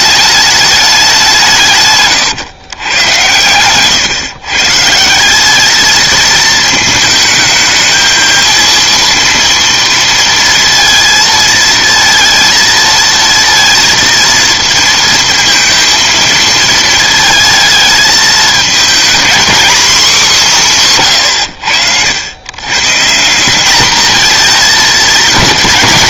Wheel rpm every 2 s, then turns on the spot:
210, 120, 140, 220, 230, 230, 220, 220, 220, 230, 190, 120, 220.
none